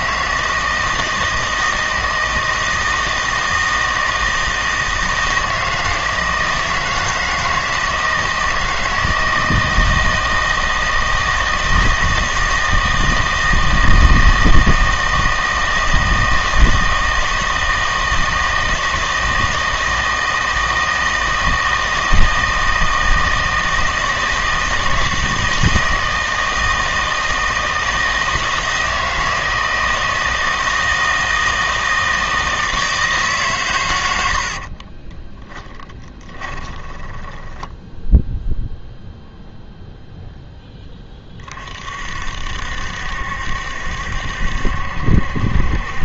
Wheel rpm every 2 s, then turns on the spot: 160, 160, 160, 160, 160, 160, 160, 160, 160, 160, 160, 160, 160, 160, 160, 160, 160, 50, 20, 0, 10, 60, 70.
34-38